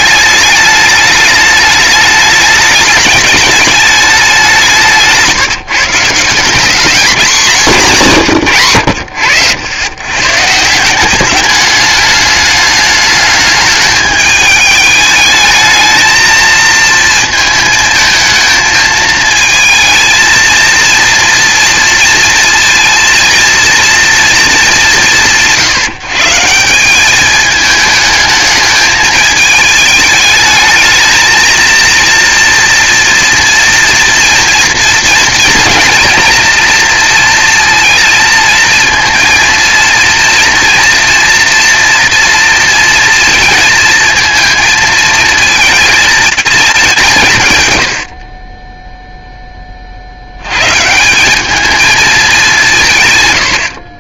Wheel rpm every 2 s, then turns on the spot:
210, 210, 200, 200, 90, 180, 210, 210, 230, 220, 230, 230, 180, 180, 210, 220, 230, 230, 240, 220, 230, 230, 220, 190, 10, 140, 160.
none